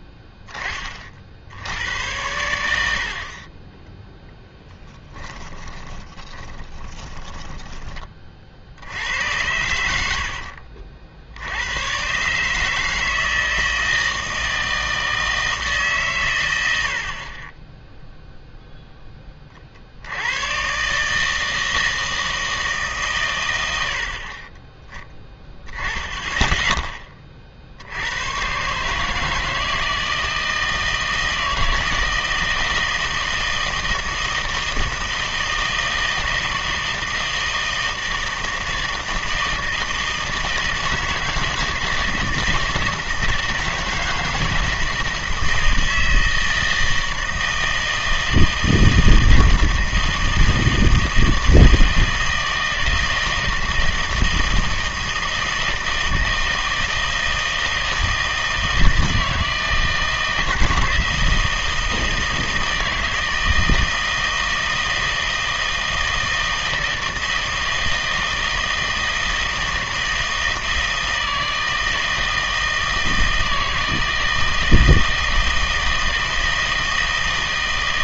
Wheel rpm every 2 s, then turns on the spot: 20, 80, 10, 20, 60, 50, 150, 160, 100, 0, 130, 150, 20, 10, 140, 160, 160, 160, 160, 160, 160, 160, 160, 160, 160, 160, 160, 160, 160, 160, 160, 160, 160, 160, 160, 160, 160, 160, 160.
4-8